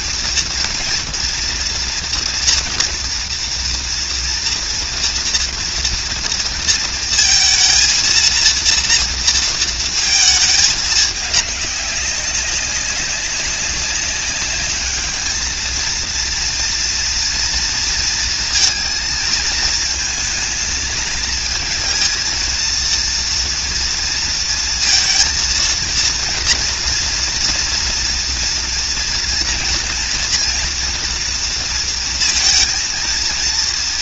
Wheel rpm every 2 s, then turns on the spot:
230, 240, 230, 230, 230, 220, 200, 210, 230, 230, 230, 230, 230, 230, 230, 230, 230.
none